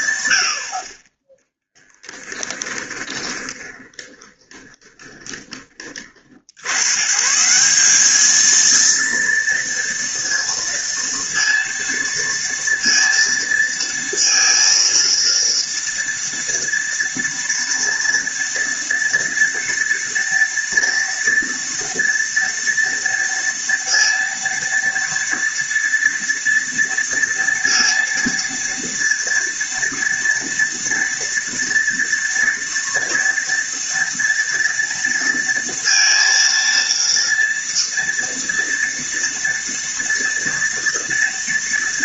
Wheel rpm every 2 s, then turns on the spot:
40, 20, 20, 120, 230, 230, 230, 230, 230, 230, 240, 230, 230, 230, 230, 230, 230, 230, 230, 230, 240.
2-6